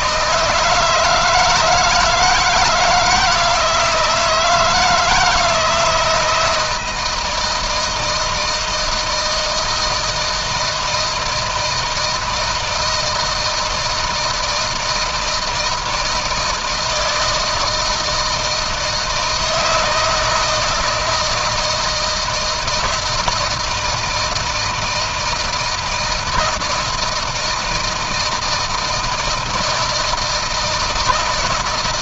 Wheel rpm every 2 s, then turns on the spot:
150, 160, 160, 160, 160, 160, 160, 160, 160, 160, 160, 160, 170, 160, 160, 160.
none